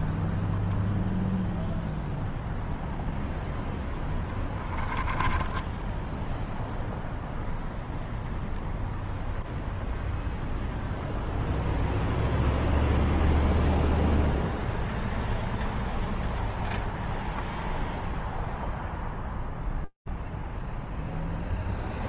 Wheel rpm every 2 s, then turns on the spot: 0, 0, 10, 0, 0, 0, 0, 0, 0, 0, 0.
4-6